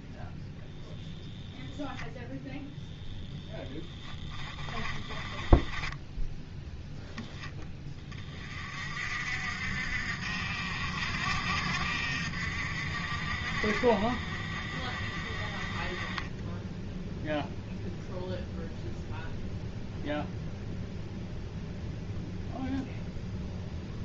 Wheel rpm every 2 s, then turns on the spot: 0, 10, 20, 20, 40, 70, 60, 40, 10, 0, 0, 0.
4-6